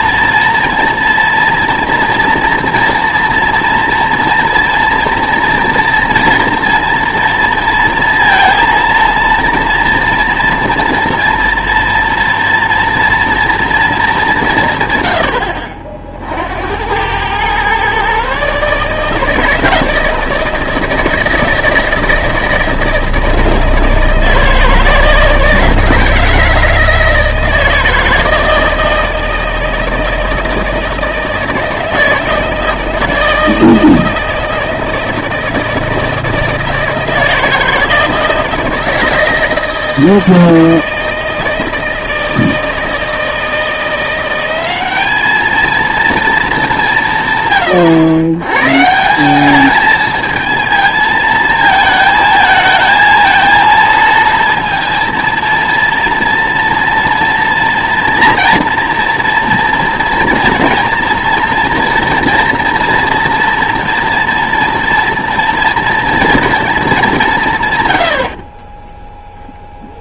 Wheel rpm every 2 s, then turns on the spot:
230, 240, 240, 230, 230, 230, 230, 140, 80, 150, 160, 160, 160, 160, 160, 160, 160, 160, 160, 160, 160, 160, 200, 190, 140, 220, 220, 230, 230, 230, 230, 230, 230, 220, 20.
none